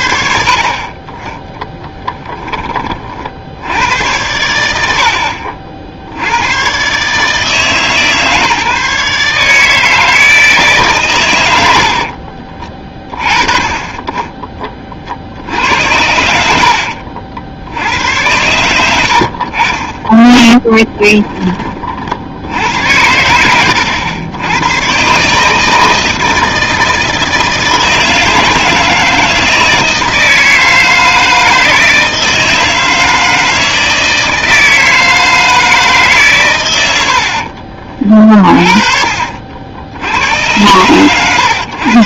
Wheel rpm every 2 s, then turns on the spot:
50, 30, 90, 110, 150, 150, 30, 30, 70, 90, 10, 90, 90, 160, 160, 160, 160, 160, 110, 30, 110.
20-22 38-40